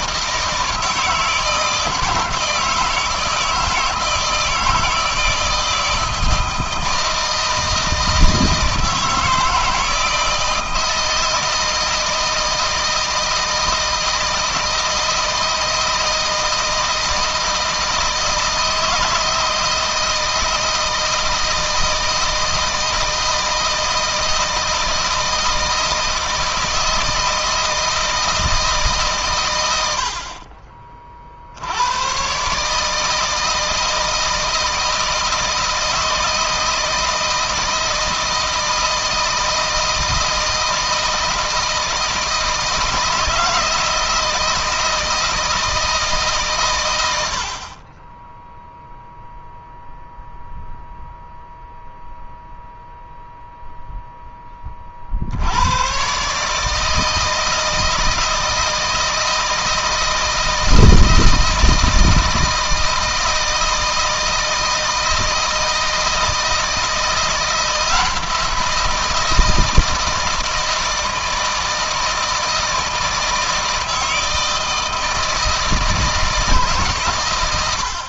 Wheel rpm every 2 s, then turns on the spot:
160, 160, 160, 160, 160, 160, 160, 160, 160, 160, 160, 160, 160, 160, 130, 30, 150, 160, 160, 160, 160, 160, 160, 110, 0, 0, 0, 40, 160, 160, 160, 160, 160, 170, 170, 160, 160, 160, 130.
none